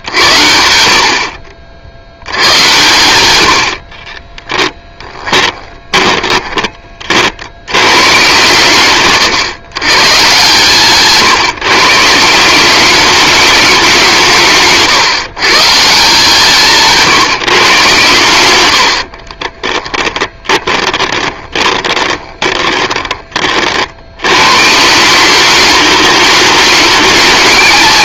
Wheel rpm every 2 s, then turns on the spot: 70, 110, 20, 30, 140, 140, 200, 150, 160, 80, 20, 20, 160, 210.
4-6 10-12 18-24